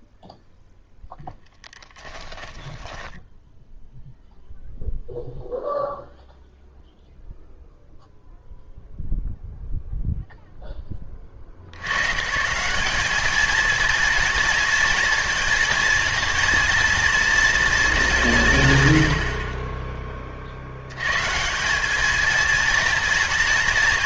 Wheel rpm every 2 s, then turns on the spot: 0, 10, 0, 0, 0, 10, 190, 230, 230, 110, 80, 220.
2-4